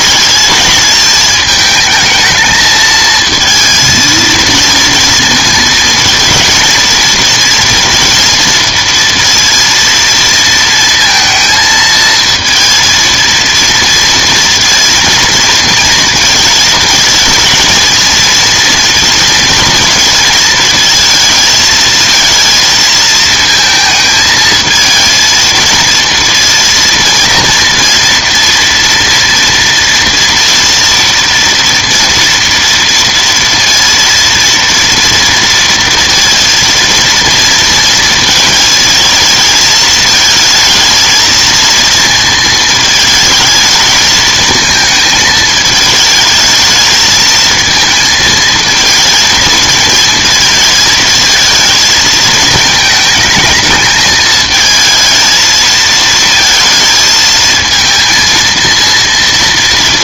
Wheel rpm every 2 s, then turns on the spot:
220, 220, 230, 230, 230, 230, 230, 230, 220, 230, 220, 230, 220, 230, 230, 230, 230, 230, 230, 220, 220, 220, 220, 220, 220, 220, 220, 220, 230, 230.
none